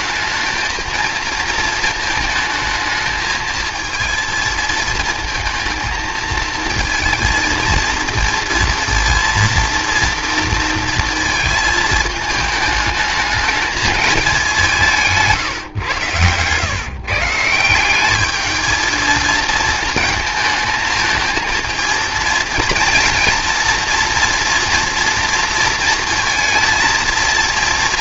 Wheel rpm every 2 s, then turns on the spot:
230, 220, 230, 220, 230, 230, 220, 180, 130, 230, 220, 230, 230, 230.
none